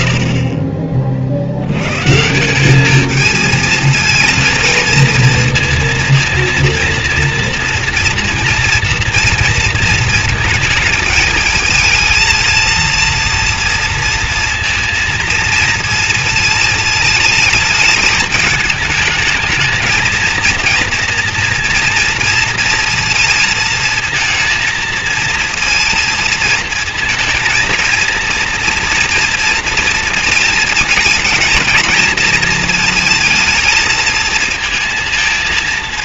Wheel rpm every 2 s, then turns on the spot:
20, 210, 230, 230, 230, 220, 230, 230, 220, 220, 230, 230, 220, 230, 230, 220, 220, 230.
none